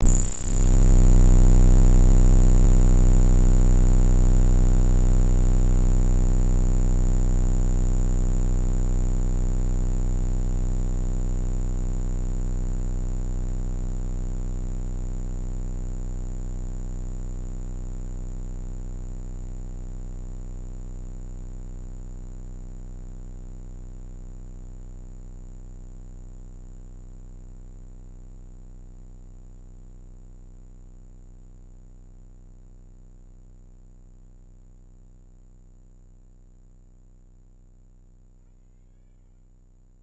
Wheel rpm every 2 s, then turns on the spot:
0, 0, 0, 0, 0, 0, 0, 0, 0, 0, 0, 0, 0, 0, 0, 0, 0, 0, 0, 40.
none